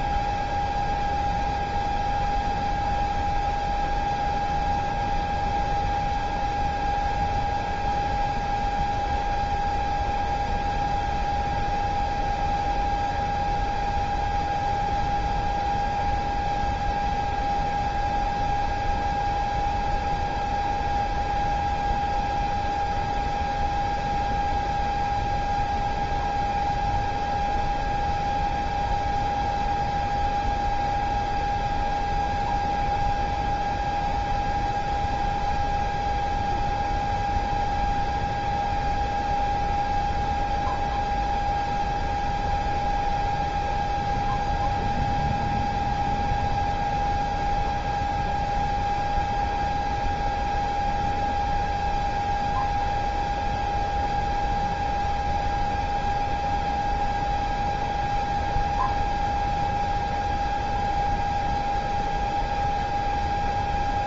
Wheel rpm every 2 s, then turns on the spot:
0, 0, 0, 0, 0, 0, 0, 0, 0, 0, 0, 0, 0, 0, 0, 0, 0, 0, 0, 0, 0, 0, 0, 0, 0, 0, 0, 0, 0, 0, 0, 0.
none